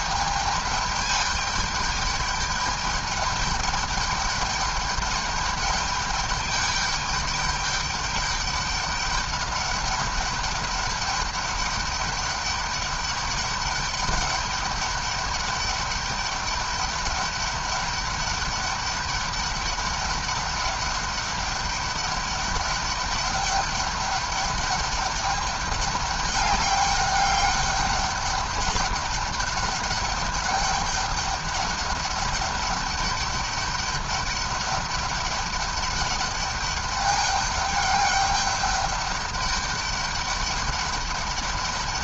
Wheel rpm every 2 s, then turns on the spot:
210, 210, 210, 200, 200, 200, 200, 200, 200, 200, 200, 200, 200, 200, 200, 200, 200, 200, 200, 200, 200.
none